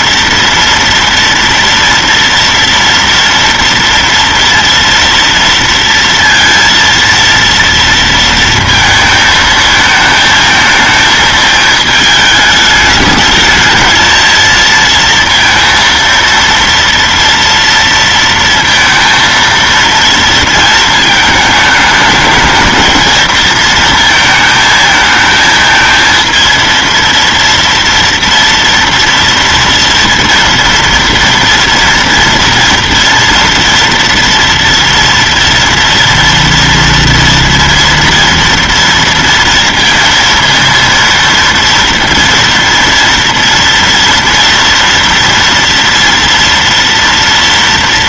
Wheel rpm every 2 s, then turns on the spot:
230, 230, 230, 230, 230, 220, 210, 230, 230, 230, 220, 230, 220, 230, 230, 230, 230, 230, 230, 230, 230, 230, 240, 230.
none